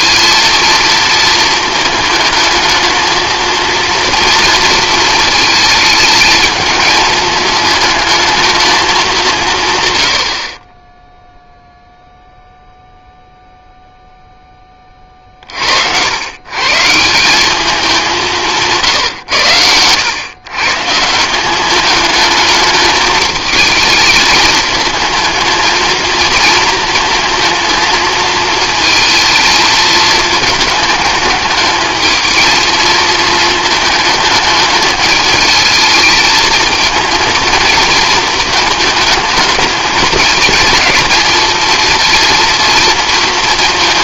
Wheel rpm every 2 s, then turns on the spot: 230, 220, 230, 220, 220, 20, 0, 20, 150, 150, 140, 210, 220, 230, 220, 210, 220, 220, 220, 220, 230, 230.
none